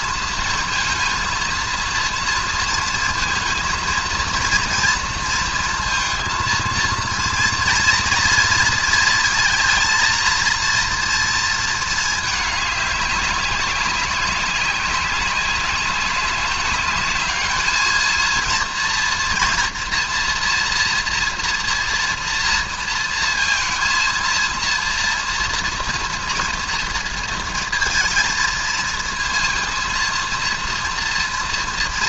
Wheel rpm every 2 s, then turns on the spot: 230, 230, 230, 230, 230, 230, 210, 190, 200, 230, 240, 230, 230, 230, 230, 230.
none